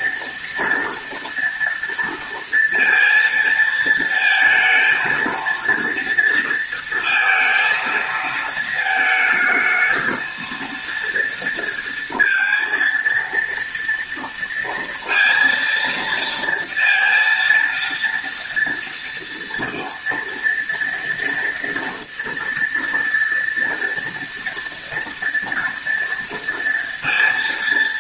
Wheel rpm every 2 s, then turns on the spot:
240, 230, 230, 230, 220, 230, 230, 230, 230, 230, 230, 230, 240, 230.
none